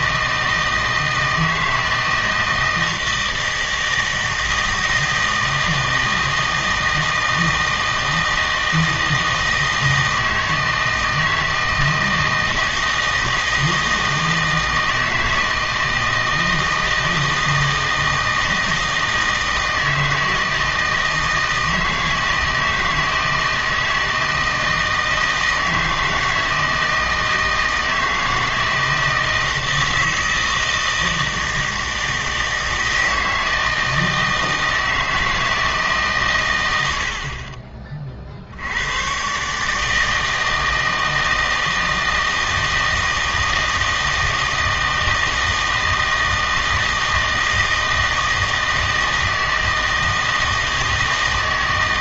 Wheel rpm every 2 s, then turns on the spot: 160, 160, 160, 160, 160, 160, 160, 160, 160, 160, 160, 160, 160, 160, 160, 160, 160, 160, 80, 90, 160, 160, 160, 160, 160, 160.
none